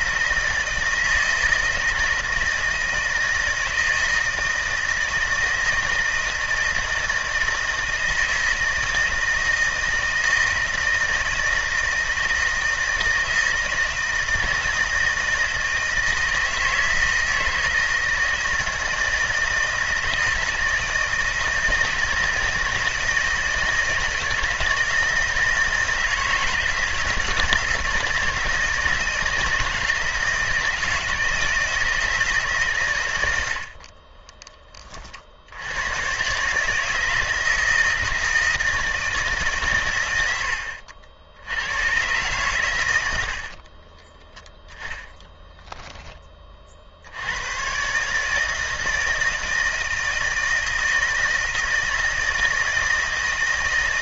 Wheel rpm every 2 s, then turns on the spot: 160, 160, 160, 160, 160, 160, 160, 160, 160, 160, 160, 160, 160, 160, 160, 160, 130, 40, 160, 160, 70, 100, 10, 60, 160, 160, 160.
none